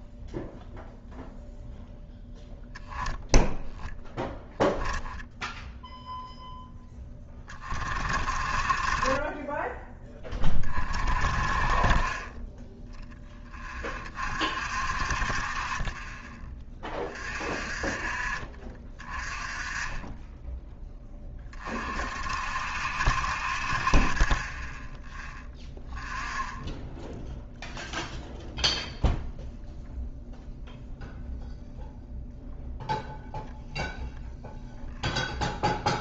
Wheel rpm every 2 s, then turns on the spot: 0, 0, 20, 10, 30, 30, 10, 50, 30, 30, 20, 60, 10, 0, 0, 0, 0, 0.
none